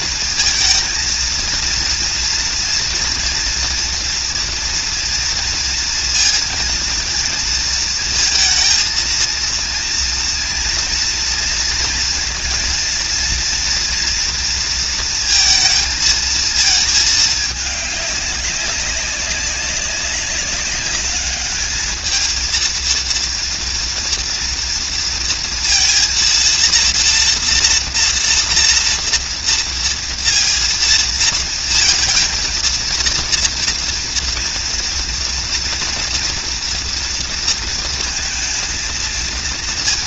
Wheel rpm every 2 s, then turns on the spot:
230, 230, 240, 230, 230, 230, 230, 230, 220, 200, 200, 220, 230, 230, 230, 230, 230, 230, 240, 230.
none